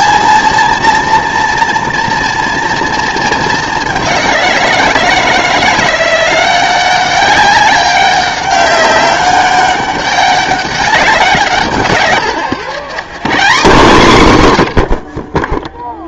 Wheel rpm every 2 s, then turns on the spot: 230, 230, 170, 180, 200, 200, 160, 120.
none